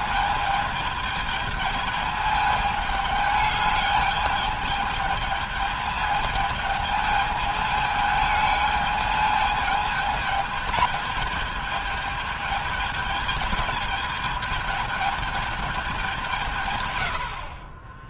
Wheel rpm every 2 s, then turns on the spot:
220, 210, 210, 220, 210, 220, 210, 220, 140.
none